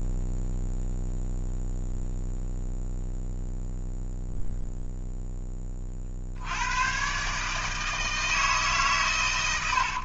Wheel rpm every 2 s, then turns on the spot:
0, 0, 0, 100, 150.
none